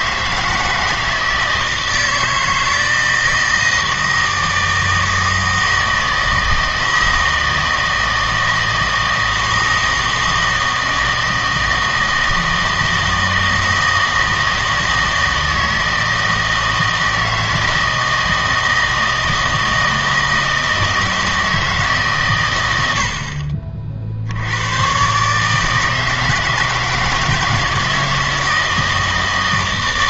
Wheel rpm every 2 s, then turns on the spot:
160, 160, 160, 160, 160, 160, 160, 160, 160, 160, 160, 110, 100, 160, 160.
none